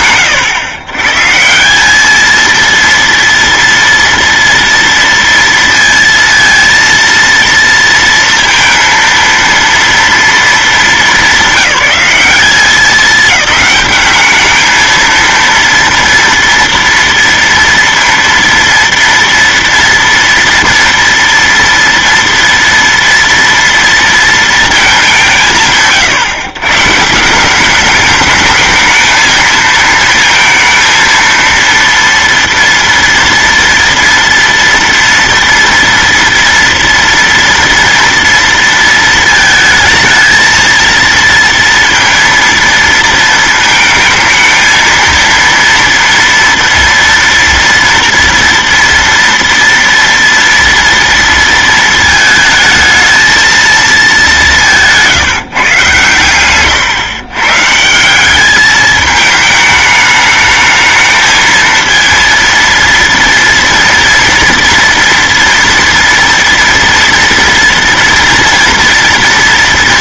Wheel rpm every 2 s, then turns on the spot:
130, 230, 230, 230, 230, 190, 200, 220, 230, 230, 230, 230, 180, 140, 220, 230, 230, 230, 230, 230, 230, 230, 230, 230, 230, 230, 220, 160, 120, 210, 220, 230, 230, 230, 230.
none